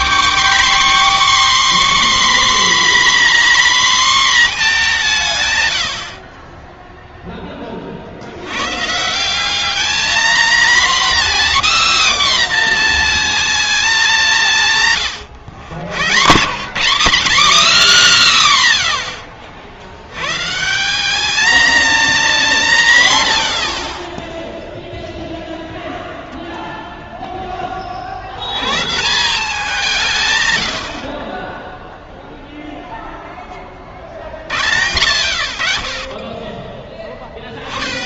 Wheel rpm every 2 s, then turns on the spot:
290, 260, 230, 40, 80, 240, 270, 160, 110, 10, 120, 210, 10, 0, 70, 130, 0, 40, 20.
36-38